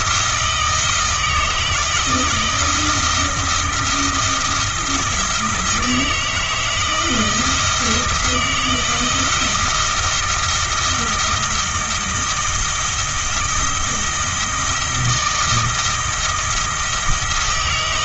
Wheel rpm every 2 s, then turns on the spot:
160, 160, 170, 160, 160, 170, 160, 160, 160.
none